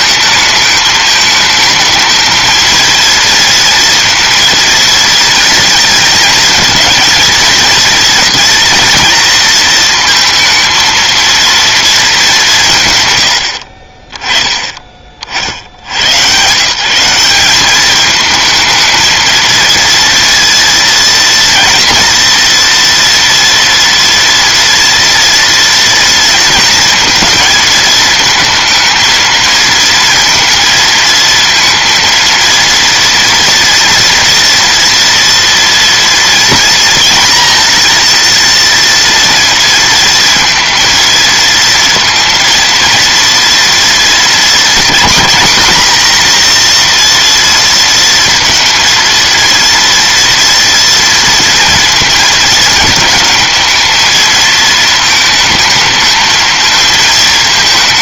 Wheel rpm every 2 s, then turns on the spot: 220, 230, 230, 230, 230, 230, 120, 30, 160, 230, 230, 240, 230, 230, 220, 220, 230, 230, 230, 230, 230, 230, 250, 240, 230, 230, 220, 220, 220.
none